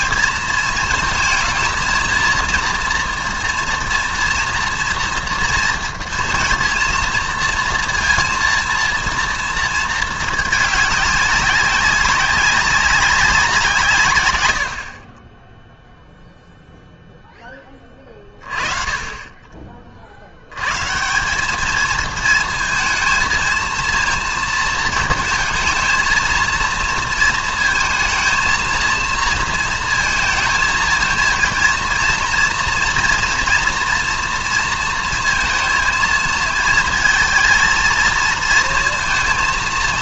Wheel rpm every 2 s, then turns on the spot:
220, 230, 230, 230, 230, 210, 200, 80, 0, 40, 110, 230, 230, 230, 220, 230, 230, 230, 220, 230.
none